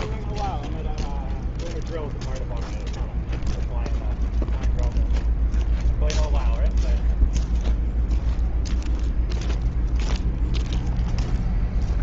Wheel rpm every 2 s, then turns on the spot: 0, 0, 0, 0, 0, 0.
none